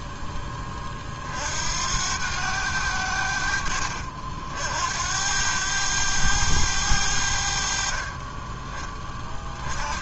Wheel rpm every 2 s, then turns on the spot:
10, 100, 70, 100, 20.
none